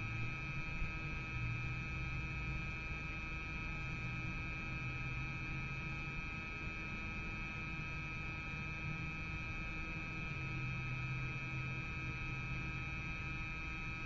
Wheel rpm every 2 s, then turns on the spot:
0, 0, 0, 0, 0, 0, 0.
none